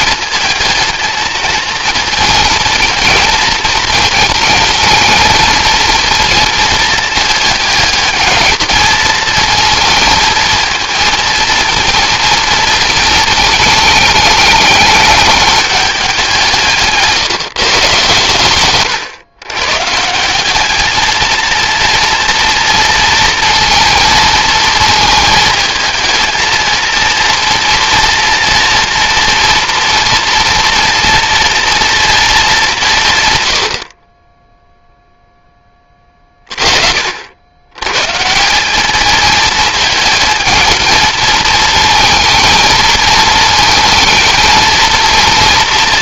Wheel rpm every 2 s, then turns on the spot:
230, 230, 220, 220, 220, 230, 220, 210, 150, 120, 230, 230, 220, 230, 230, 230, 130, 0, 80, 220, 220, 220, 230.
none